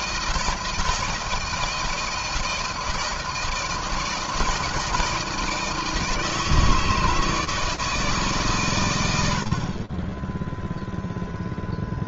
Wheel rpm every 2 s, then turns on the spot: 160, 170, 160, 160, 130, 0.
none